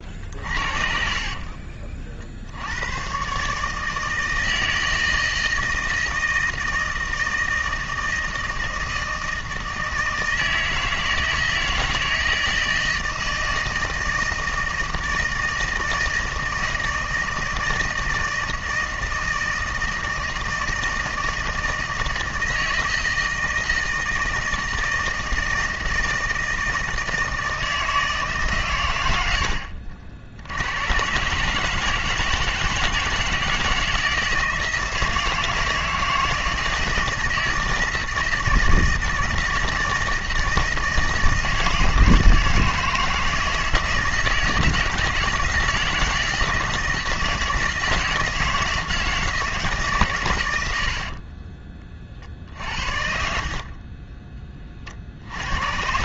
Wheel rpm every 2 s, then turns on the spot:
40, 130, 160, 160, 160, 160, 160, 160, 160, 160, 160, 160, 160, 160, 100, 120, 160, 160, 160, 160, 160, 160, 160, 160, 160, 50, 70, 40.
0-2 50-52